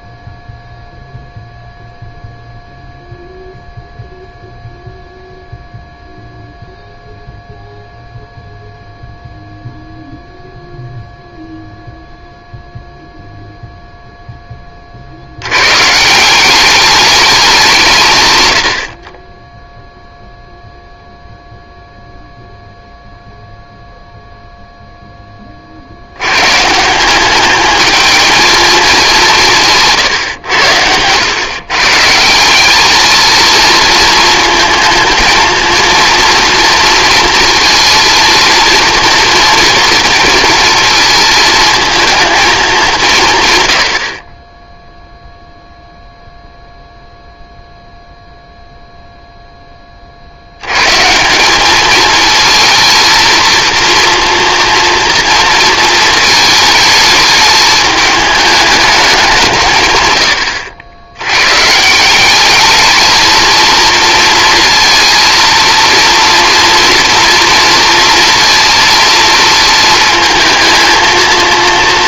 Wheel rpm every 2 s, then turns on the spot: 0, 0, 0, 0, 0, 0, 0, 30, 200, 80, 0, 0, 0, 150, 220, 90, 190, 220, 230, 230, 230, 200, 10, 0, 0, 90, 220, 230, 220, 210, 90, 210, 230, 230, 230, 220.
none